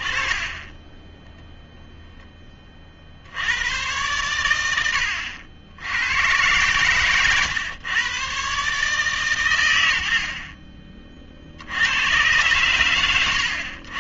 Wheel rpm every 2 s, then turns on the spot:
10, 30, 80, 120, 130, 30, 110.
none